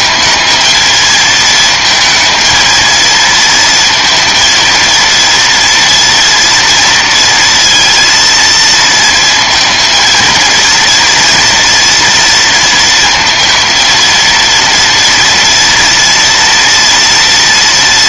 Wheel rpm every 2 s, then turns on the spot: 220, 230, 230, 230, 230, 230, 230, 230, 230.
none